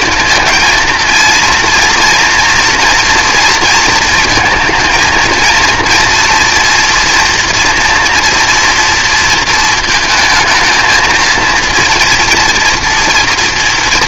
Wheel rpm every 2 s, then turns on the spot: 230, 230, 230, 230, 230, 220, 240.
none